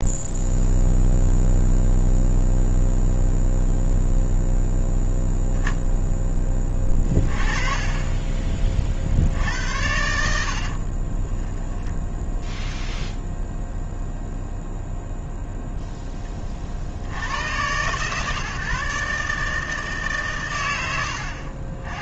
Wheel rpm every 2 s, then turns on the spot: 0, 0, 0, 20, 40, 50, 0, 0, 60, 140, 110.
10-12